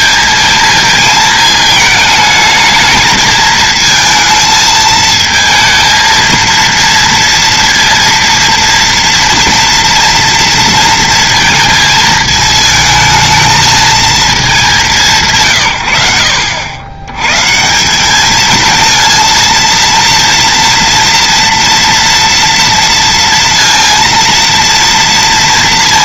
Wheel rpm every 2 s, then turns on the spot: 220, 210, 220, 230, 230, 230, 220, 200, 80, 220, 230, 230, 230.
none